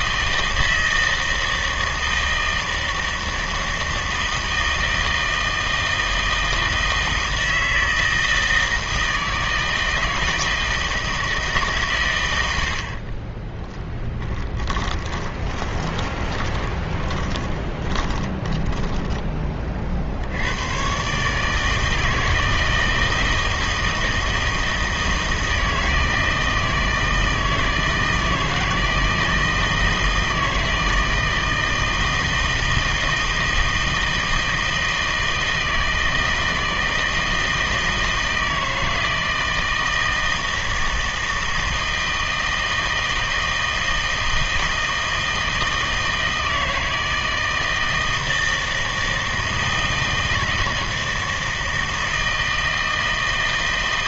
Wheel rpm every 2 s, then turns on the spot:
160, 160, 160, 160, 160, 160, 70, 30, 20, 10, 110, 160, 160, 160, 160, 160, 160, 160, 160, 160, 160, 160, 160, 160, 160, 160, 160.
14-18